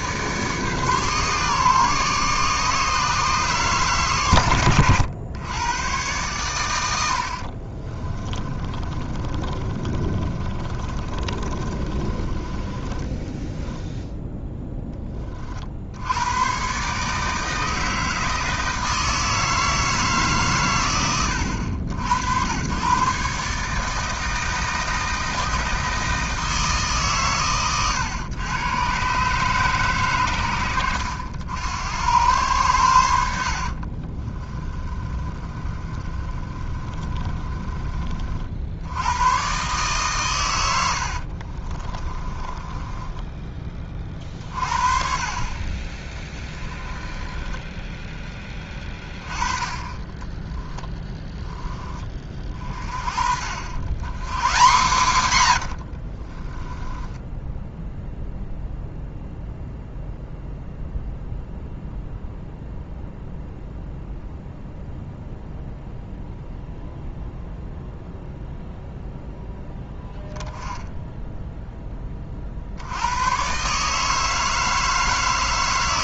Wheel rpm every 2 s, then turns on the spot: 140, 150, 110, 100, 30, 30, 20, 10, 120, 160, 120, 120, 160, 160, 120, 100, 100, 30, 30, 60, 100, 20, 40, 20, 20, 20, 40, 160, 10, 0, 0, 0, 0, 0, 0, 10, 60, 160.
8-14 34-38 42-44 46-48 50-52 54-58